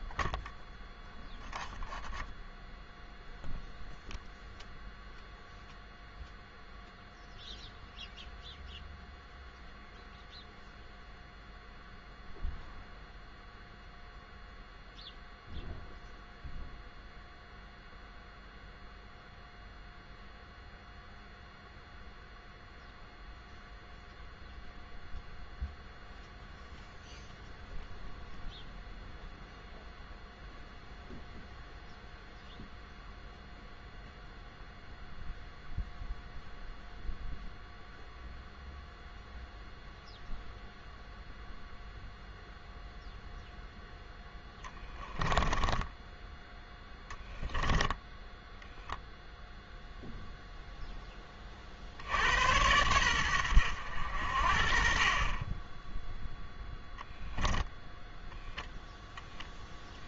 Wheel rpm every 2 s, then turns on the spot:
0, 0, 0, 0, 0, 0, 0, 0, 0, 0, 0, 0, 0, 0, 0, 0, 0, 0, 0, 0, 0, 0, 10, 0, 0, 10, 100, 40, 0, 0.
44-46